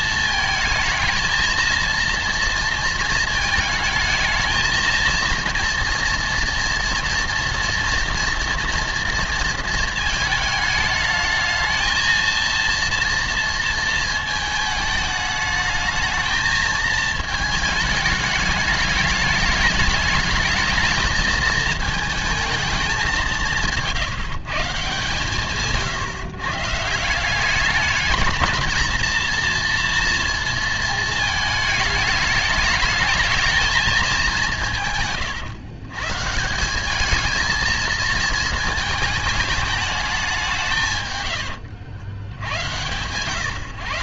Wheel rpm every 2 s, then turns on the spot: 220, 230, 220, 230, 230, 220, 230, 220, 220, 210, 220, 220, 150, 140, 220, 230, 220, 170, 180, 230, 170, 120.
none